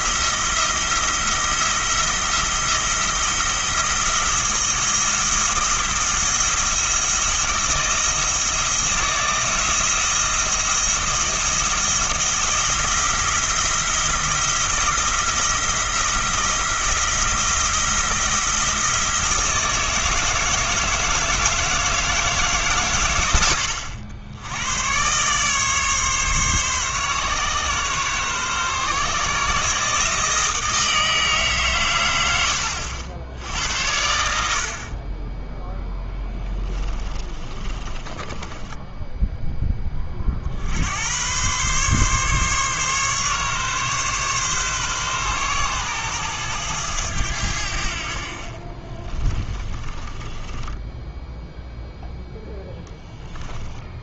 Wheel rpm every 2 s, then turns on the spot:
170, 170, 160, 170, 160, 170, 170, 170, 170, 170, 160, 130, 120, 140, 140, 160, 80, 40, 20, 10, 80, 140, 130, 100, 30, 10, 10.
36-40 48-54